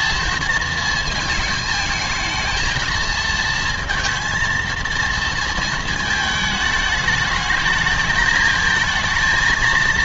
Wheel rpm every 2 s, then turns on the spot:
220, 220, 230, 210, 220.
none